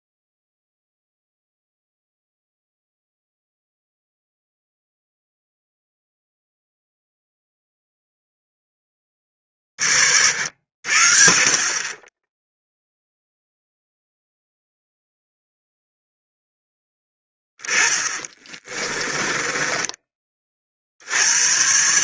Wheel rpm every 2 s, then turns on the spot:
0, 0, 0, 0, 10, 80, 10, 0, 10, 20, 40.
18-20